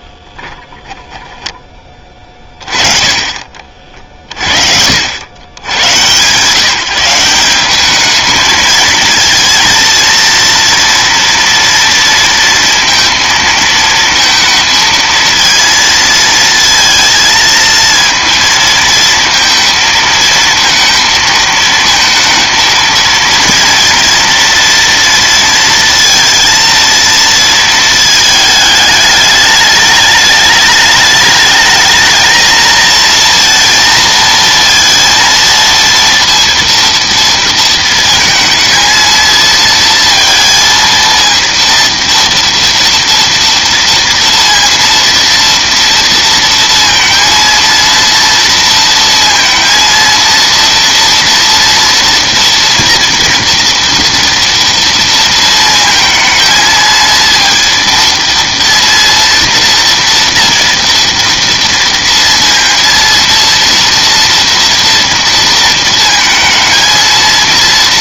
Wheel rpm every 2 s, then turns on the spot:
20, 50, 120, 210, 230, 230, 230, 230, 230, 230, 230, 230, 230, 220, 210, 220, 230, 230, 220, 230, 230, 230, 230, 230, 230, 230, 230, 230, 230, 230, 230, 230, 220, 230.
none